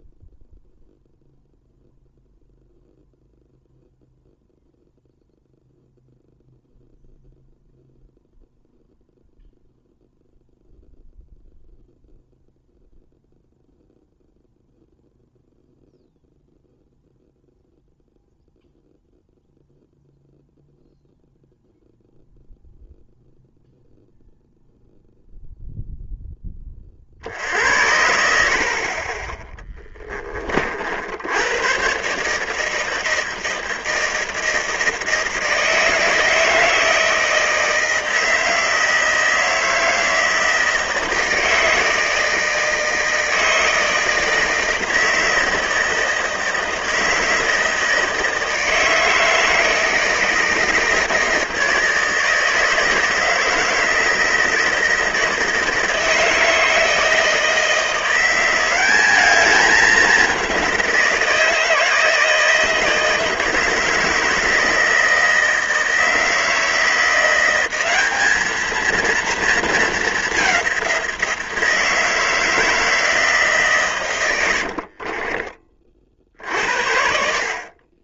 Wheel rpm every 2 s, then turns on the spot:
0, 0, 0, 0, 0, 0, 0, 0, 0, 0, 0, 0, 0, 40, 30, 60, 160, 160, 160, 160, 160, 160, 160, 160, 160, 160, 160, 160, 160, 190, 170, 160, 160, 170, 220, 190, 160, 50, 60.
74-76